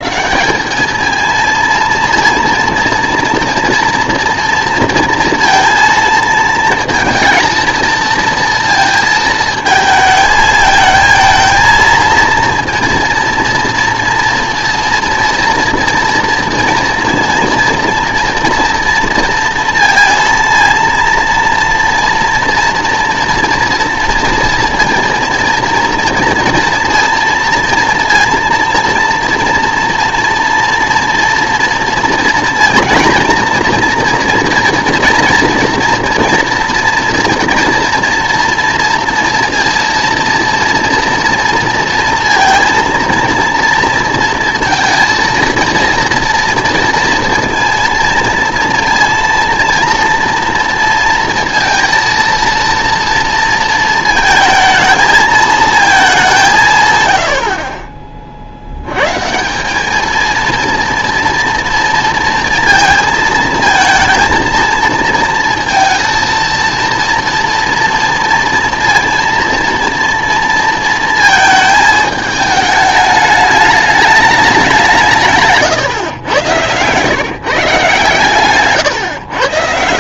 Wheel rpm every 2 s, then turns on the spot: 190, 230, 230, 220, 230, 220, 230, 230, 230, 230, 230, 230, 230, 230, 230, 240, 240, 240, 230, 230, 230, 230, 230, 230, 230, 230, 230, 220, 160, 90, 230, 230, 230, 230, 230, 230, 210, 190, 110, 150.
none